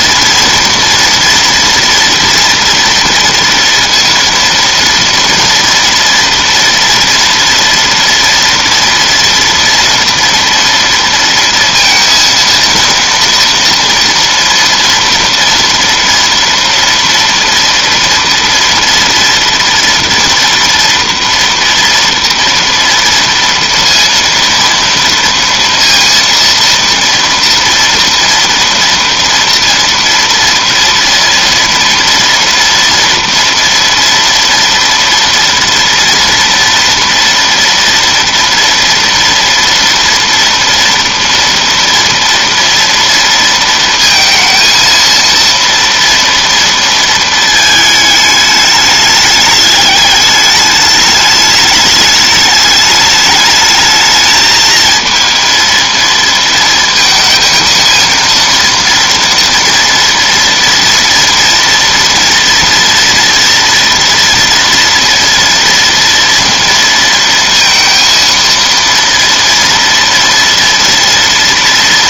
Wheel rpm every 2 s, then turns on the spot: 230, 230, 230, 230, 230, 230, 230, 230, 230, 230, 230, 230, 230, 230, 230, 230, 230, 240, 230, 230, 230, 230, 230, 230, 210, 210, 210, 220, 220, 230, 230, 230, 230, 230, 230, 240.
none